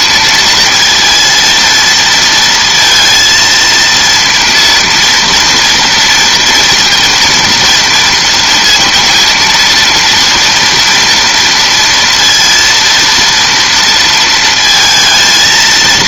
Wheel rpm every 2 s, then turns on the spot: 230, 230, 240, 230, 230, 230, 230, 220.
none